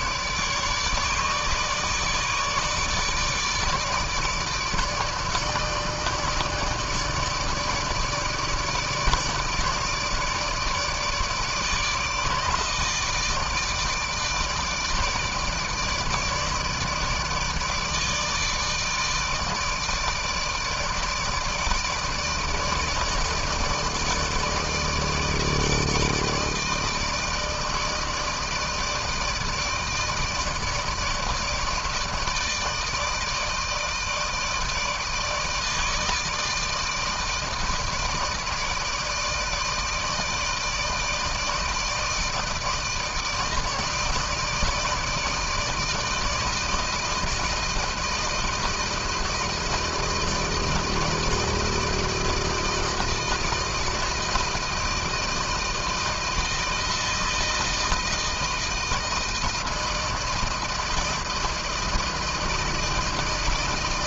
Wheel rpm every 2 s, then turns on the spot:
150, 150, 150, 160, 150, 150, 150, 150, 150, 160, 150, 160, 160, 160, 160, 160, 160, 160, 160, 160, 160, 160, 160, 160, 160, 160, 160, 160, 160, 160, 160, 160.
none